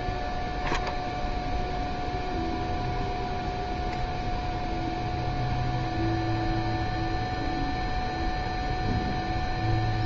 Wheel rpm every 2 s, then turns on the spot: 0, 0, 0, 0, 0.
none